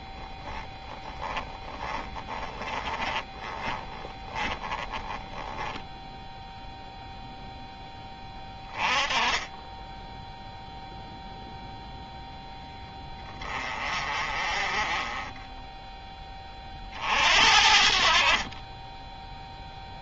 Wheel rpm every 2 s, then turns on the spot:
10, 20, 20, 0, 20, 0, 10, 20, 50, 10.
2-6